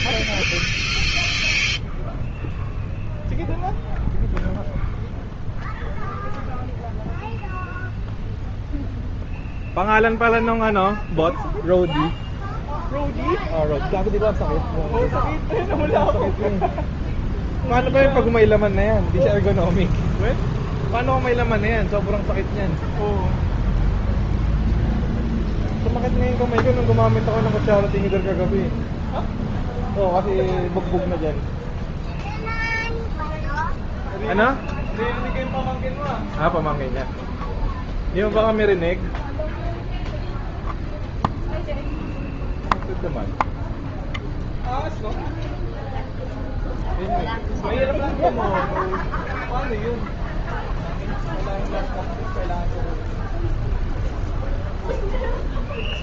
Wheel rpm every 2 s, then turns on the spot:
0, 0, 0, 0, 0, 0, 0, 0, 0, 0, 0, 0, 0, 0, 0, 0, 0, 0, 0, 0, 0, 0, 0, 0, 0, 0, 0, 0.
none